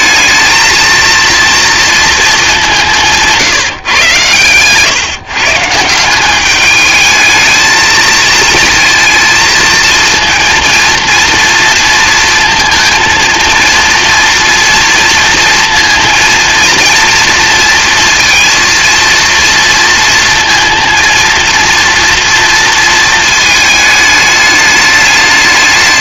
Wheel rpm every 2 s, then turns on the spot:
220, 190, 130, 210, 220, 230, 220, 230, 230, 230, 230, 230, 210.
none